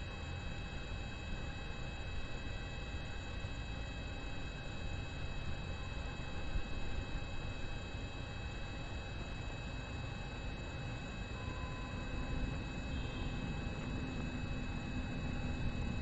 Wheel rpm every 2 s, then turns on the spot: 0, 0, 0, 0, 0, 0, 0, 0.
none